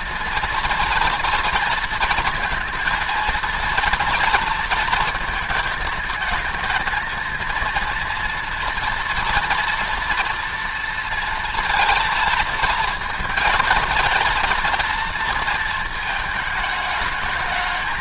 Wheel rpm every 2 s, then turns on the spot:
230, 230, 230, 220, 230, 230, 230, 230, 220.
none